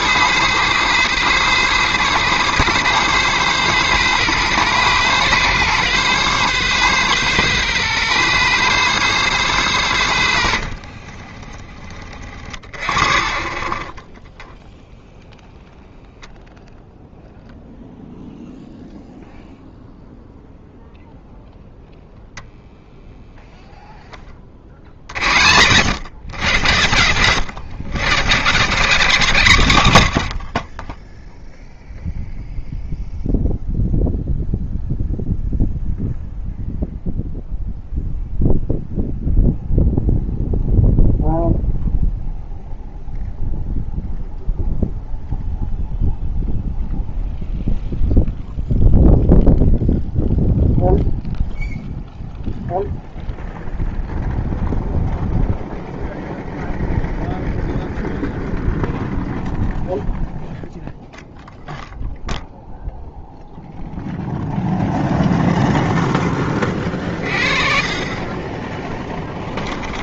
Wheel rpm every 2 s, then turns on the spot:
130, 130, 130, 140, 140, 60, 50, 0, 0, 0, 0, 0, 60, 100, 150, 30, 0, 0, 0, 0, 0, 0, 0, 0, 0, 0, 0, 0, 0, 0, 0, 0, 0, 30, 10.
30-32